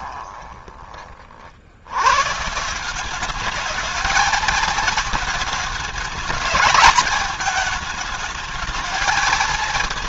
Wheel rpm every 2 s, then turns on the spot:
30, 160, 220, 220, 210.
none